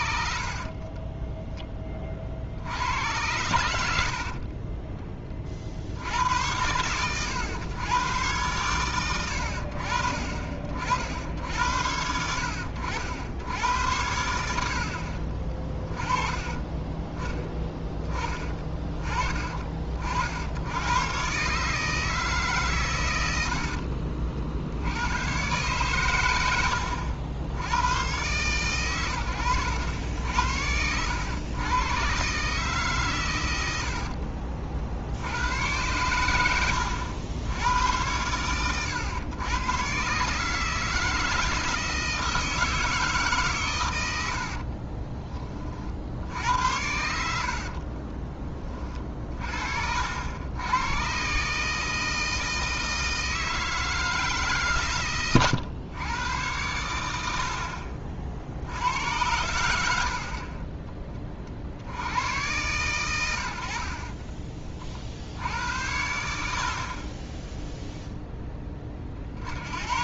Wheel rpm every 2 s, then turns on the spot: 50, 60, 30, 100, 110, 60, 70, 70, 20, 20, 100, 140, 70, 90, 120, 80, 140, 50, 100, 110, 160, 160, 60, 80, 20, 100, 160, 140, 100, 80, 30, 100, 30, 50, 10.
0-2 4-6 44-46